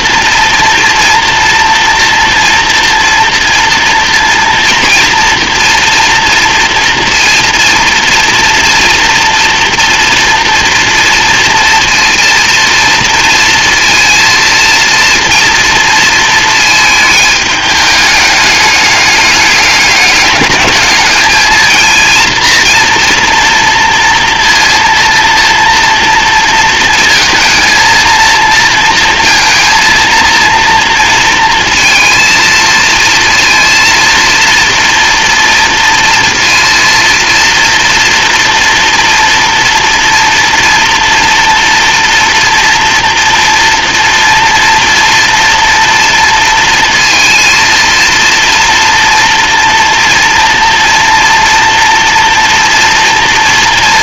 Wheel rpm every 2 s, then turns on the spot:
230, 230, 240, 230, 230, 230, 230, 230, 220, 210, 210, 230, 230, 220, 230, 230, 230, 230, 230, 230, 240, 240, 230, 230, 230, 240, 240.
none